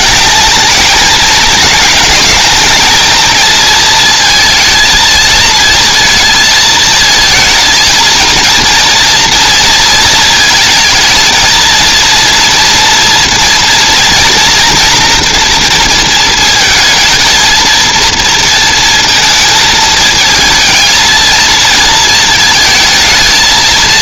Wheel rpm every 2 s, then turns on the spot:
210, 220, 230, 220, 230, 230, 230, 230, 220, 230, 220, 220.
none